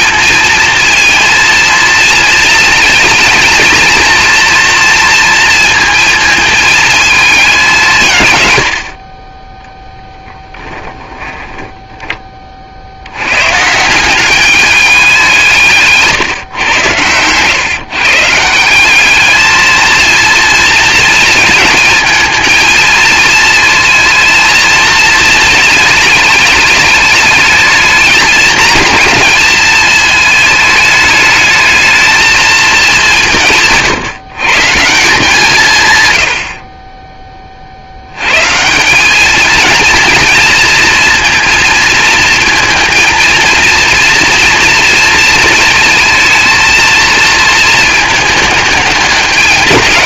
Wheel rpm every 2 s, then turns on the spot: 230, 230, 230, 220, 60, 10, 50, 200, 120, 180, 230, 220, 220, 210, 220, 210, 210, 150, 40, 160, 230, 220, 230, 230, 210.
8-12